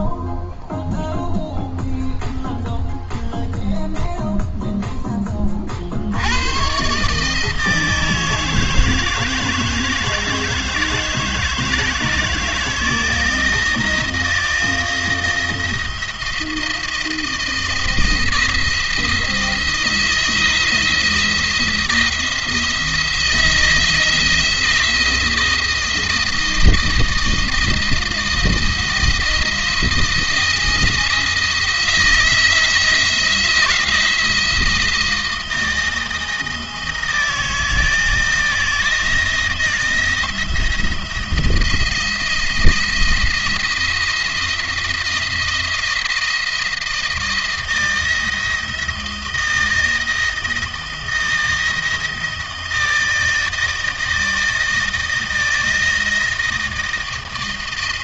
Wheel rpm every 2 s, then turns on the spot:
0, 0, 0, 120, 160, 160, 160, 170, 170, 160, 170, 170, 170, 170, 170, 170, 170, 170, 160, 170, 170, 170, 170, 170, 160, 160, 160, 160, 160.
none